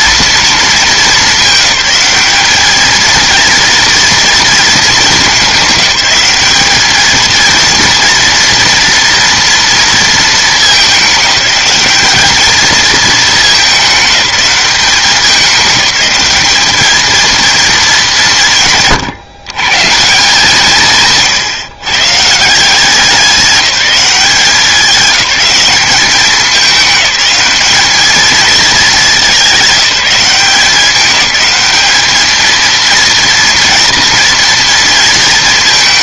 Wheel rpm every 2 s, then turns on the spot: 220, 210, 220, 200, 230, 210, 220, 200, 210, 130, 160, 160, 180, 210, 220, 190, 230, 230.
18-20